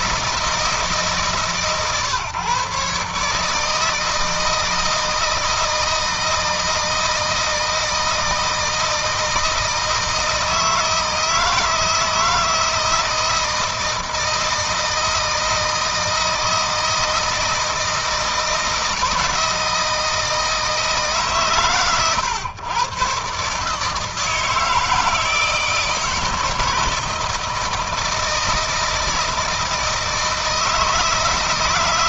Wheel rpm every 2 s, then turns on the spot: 160, 140, 160, 160, 160, 160, 160, 160, 160, 160, 160, 120, 160, 160, 160, 160.
none